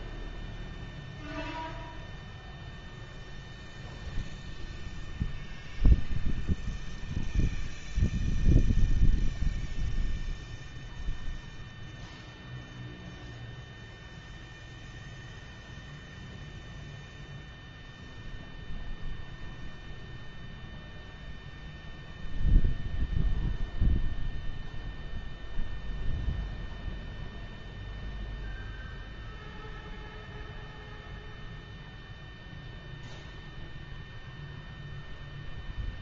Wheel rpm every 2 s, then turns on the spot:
0, 0, 0, 0, 0, 0, 0, 0, 0, 0, 0, 0, 0, 0, 0, 0, 0, 0.
none